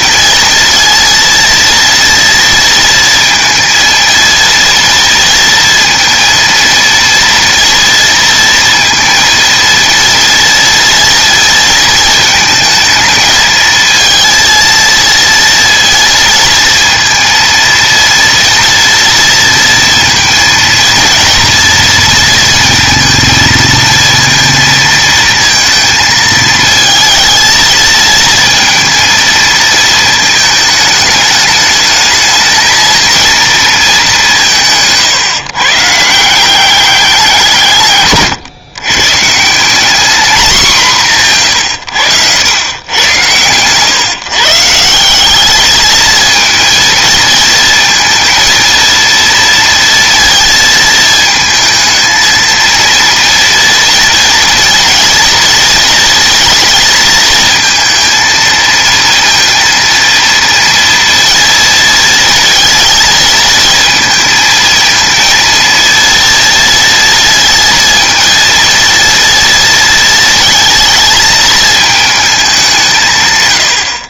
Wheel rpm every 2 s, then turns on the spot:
230, 230, 230, 230, 230, 230, 220, 230, 230, 230, 220, 230, 230, 220, 230, 220, 230, 170, 190, 120, 200, 110, 160, 230, 230, 230, 230, 230, 230, 230, 230, 230, 220, 230, 230, 220, 190.
none